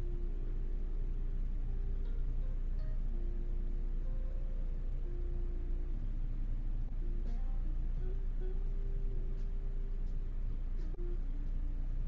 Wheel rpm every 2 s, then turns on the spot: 0, 0, 0, 0, 0, 0.
none